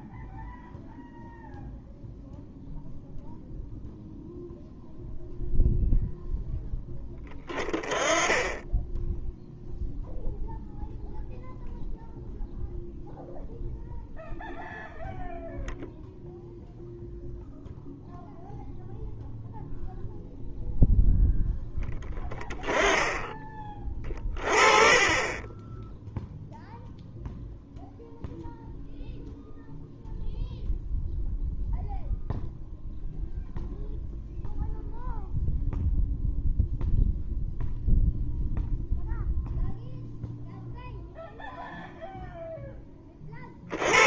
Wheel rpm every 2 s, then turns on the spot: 0, 0, 0, 10, 10, 0, 0, 0, 0, 0, 0, 10, 30, 0, 0, 0, 0, 0, 0, 0, 0, 20.
none